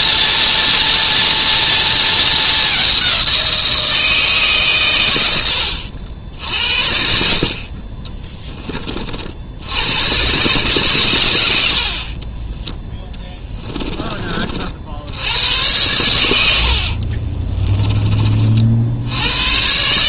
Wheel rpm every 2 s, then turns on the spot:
230, 210, 130, 70, 20, 130, 10, 50, 70, 60.
16-18